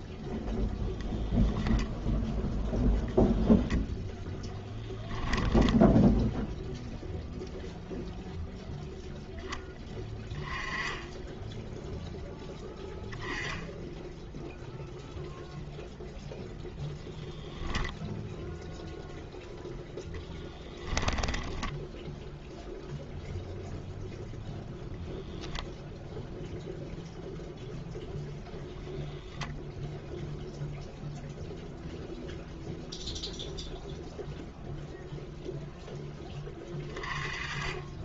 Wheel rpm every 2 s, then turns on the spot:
0, 0, 10, 0, 0, 10, 10, 0, 0, 0, 10, 0, 0, 0, 0, 0, 0, 0, 20.
none